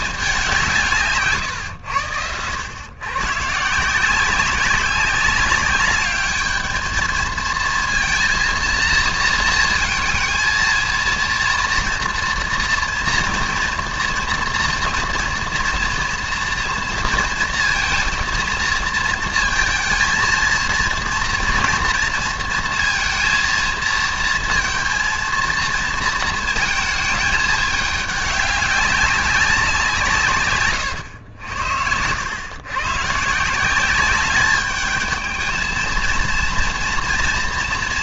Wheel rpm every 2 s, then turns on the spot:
190, 90, 190, 210, 230, 230, 240, 230, 230, 230, 230, 230, 230, 220, 200, 140, 110, 200, 230.
none